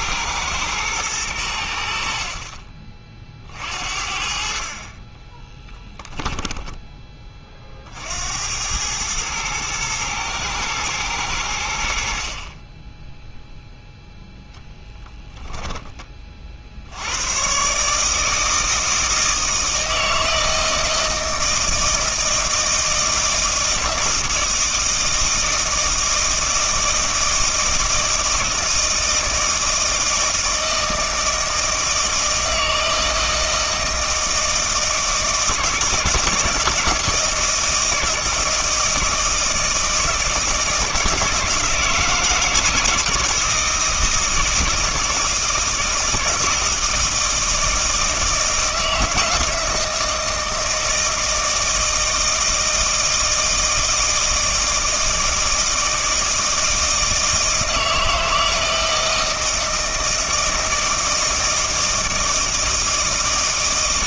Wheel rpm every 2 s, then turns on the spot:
110, 40, 40, 10, 100, 110, 20, 0, 60, 160, 160, 160, 160, 160, 160, 160, 160, 160, 170, 160, 160, 160, 160, 160, 160, 160, 160, 160, 160, 160, 160, 160.
none